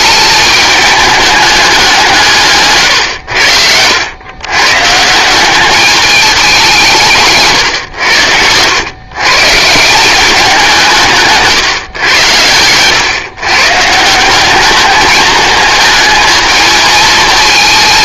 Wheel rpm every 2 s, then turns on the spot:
210, 150, 120, 200, 90, 190, 110, 190, 220.
none